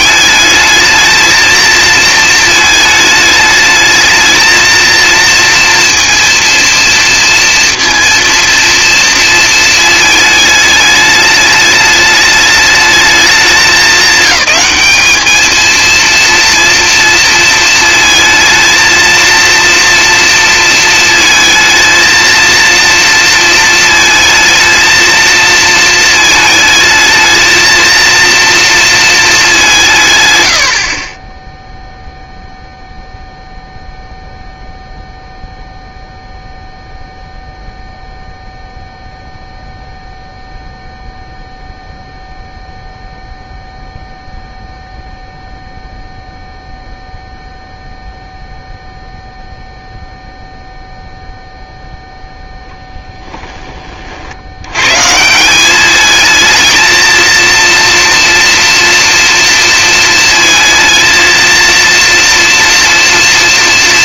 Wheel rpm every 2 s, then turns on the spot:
220, 220, 230, 230, 230, 210, 210, 210, 230, 230, 230, 230, 220, 220, 230, 50, 0, 0, 0, 0, 0, 0, 0, 0, 0, 0, 0, 130, 230, 230, 230, 230.
30-32